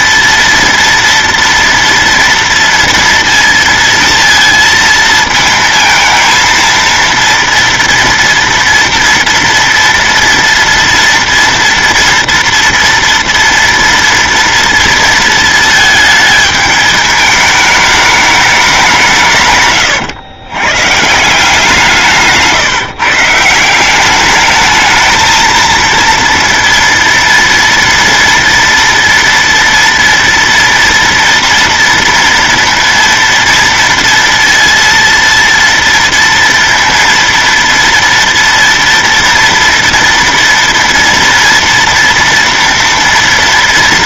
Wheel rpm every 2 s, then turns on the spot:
230, 230, 230, 230, 230, 230, 230, 230, 210, 190, 120, 150, 210, 230, 230, 240, 230, 230, 230, 230, 230, 230.
none